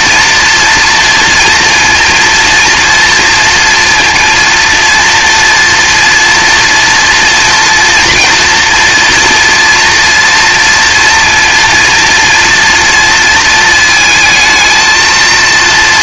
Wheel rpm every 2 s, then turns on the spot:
230, 240, 230, 230, 230, 230, 230, 220.
none